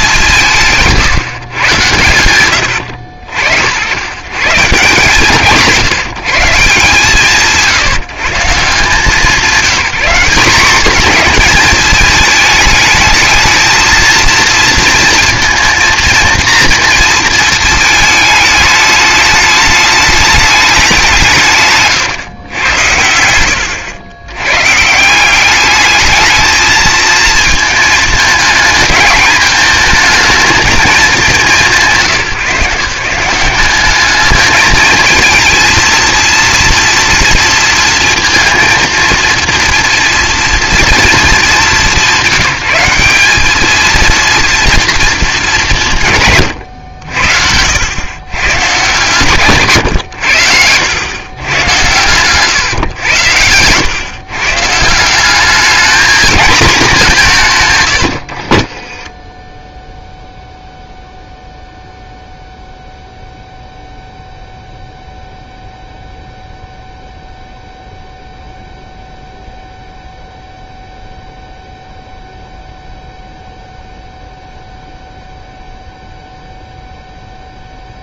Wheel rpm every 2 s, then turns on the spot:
180, 100, 150, 150, 160, 220, 220, 230, 230, 210, 210, 110, 120, 220, 220, 220, 150, 220, 230, 230, 240, 180, 230, 120, 120, 100, 130, 140, 220, 50, 0, 0, 0, 0, 0, 0, 0, 0, 0.
50-54 58-60